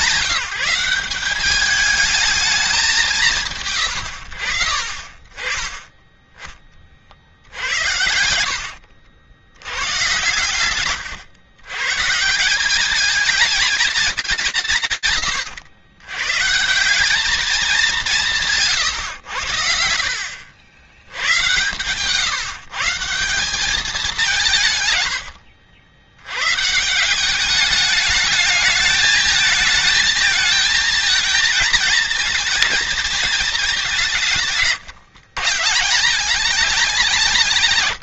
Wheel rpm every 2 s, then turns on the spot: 160, 210, 60, 20, 80, 130, 180, 160, 190, 100, 80, 170, 110, 170, 220, 220, 220, 130, 180.
8-10